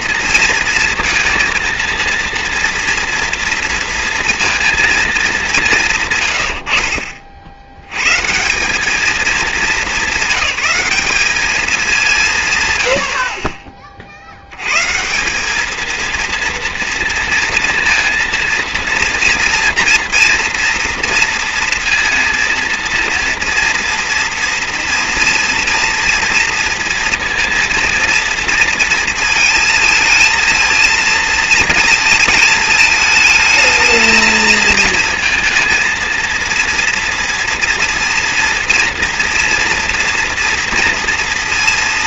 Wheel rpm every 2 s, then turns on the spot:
230, 230, 230, 80, 170, 200, 130, 110, 230, 230, 230, 230, 230, 230, 230, 230, 220, 220, 230, 230, 230.
none